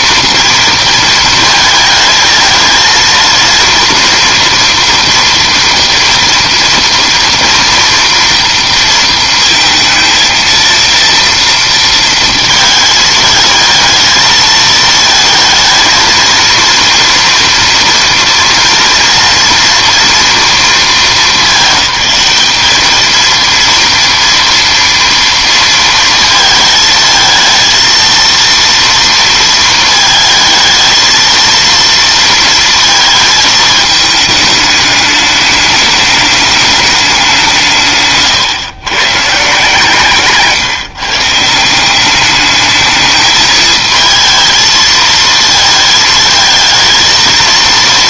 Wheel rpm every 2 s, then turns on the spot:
230, 230, 240, 230, 230, 230, 220, 220, 230, 230, 230, 220, 230, 220, 230, 220, 230, 210, 210, 130, 150, 210, 220, 230.
none